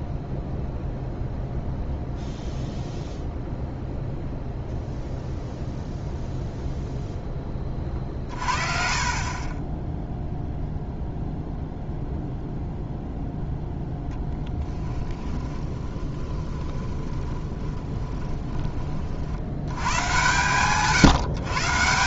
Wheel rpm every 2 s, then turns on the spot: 0, 0, 0, 0, 40, 0, 0, 10, 20, 20, 130.
8-10 16-18